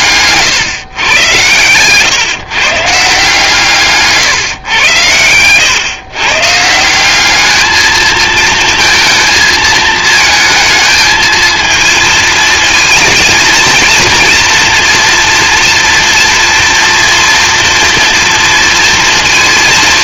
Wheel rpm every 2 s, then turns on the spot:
140, 140, 120, 160, 220, 220, 220, 230, 230, 230.
none